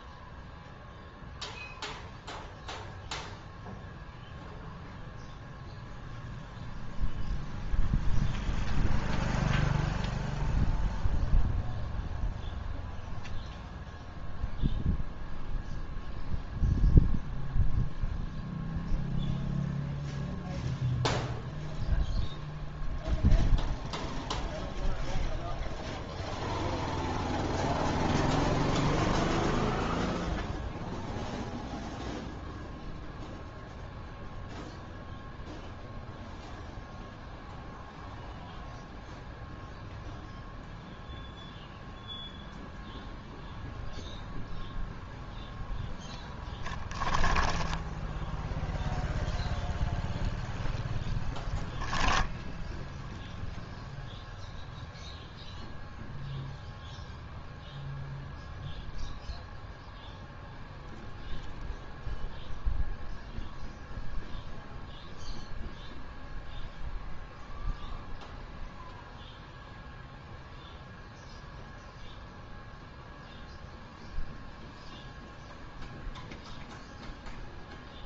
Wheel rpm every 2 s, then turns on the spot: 0, 0, 0, 0, 0, 0, 0, 0, 0, 0, 0, 0, 0, 0, 0, 0, 0, 0, 0, 0, 0, 0, 0, 10, 0, 0, 0, 0, 0, 0, 0, 0, 0, 0, 0, 0, 0, 0, 0.
none